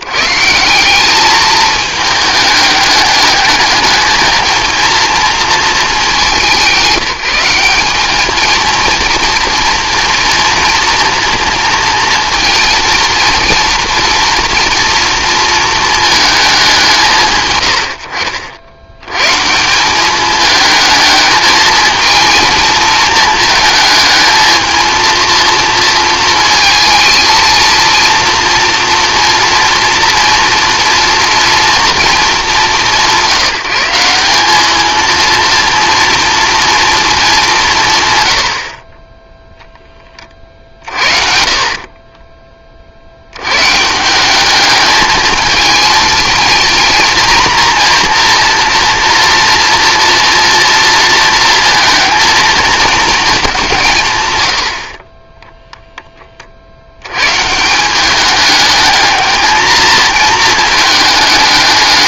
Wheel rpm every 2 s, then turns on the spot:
190, 210, 230, 190, 230, 230, 230, 230, 170, 90, 210, 220, 230, 230, 230, 230, 200, 220, 230, 40, 40, 40, 210, 230, 230, 230, 230, 60, 80, 220, 220.
40-42